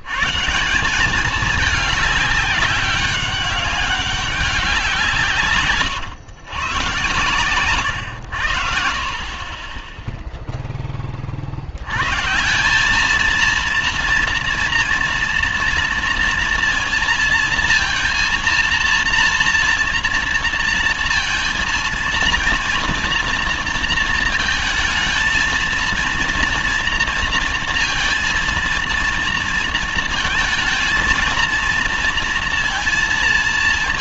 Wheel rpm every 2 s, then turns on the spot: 180, 200, 180, 120, 60, 10, 190, 240, 230, 230, 230, 240, 220, 230, 230, 230, 230.
none